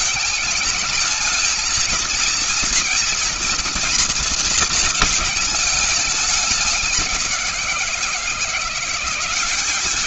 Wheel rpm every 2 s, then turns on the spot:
210, 240, 230, 190, 180.
none